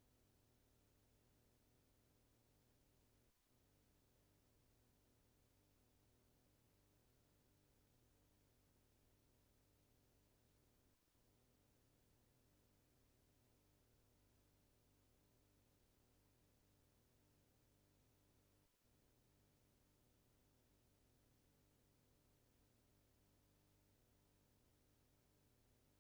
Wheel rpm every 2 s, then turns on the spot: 0, 0, 0, 0, 0, 0, 0, 0, 0, 0, 0, 0, 0.
none